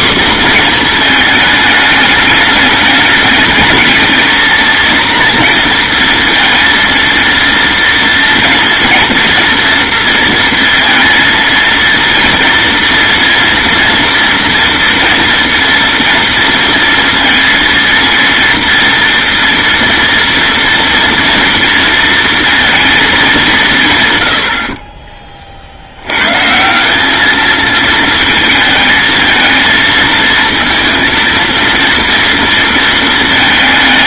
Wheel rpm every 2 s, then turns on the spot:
230, 210, 230, 230, 230, 230, 230, 230, 230, 230, 230, 220, 30, 180, 220, 230, 220.
none